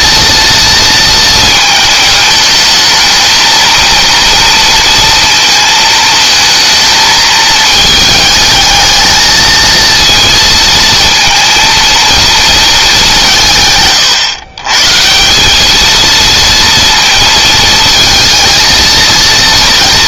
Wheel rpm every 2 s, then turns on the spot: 230, 220, 220, 220, 220, 230, 190, 170, 230, 230.
none